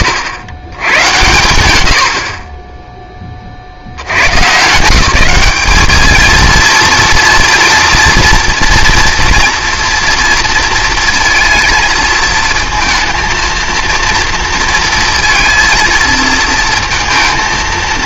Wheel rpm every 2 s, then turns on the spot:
100, 20, 130, 220, 230, 230, 220, 230, 230.
none